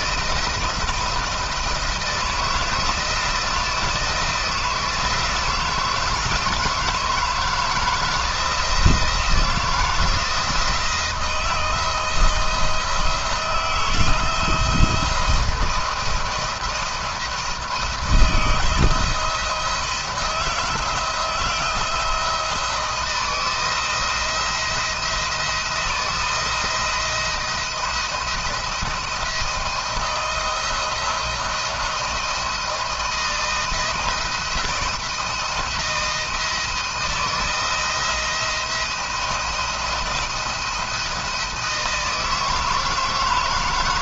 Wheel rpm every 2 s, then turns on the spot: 170, 160, 170, 170, 160, 170, 170, 170, 170, 160, 170, 170, 170, 170, 170, 170, 170, 170, 160, 170, 170, 160.
none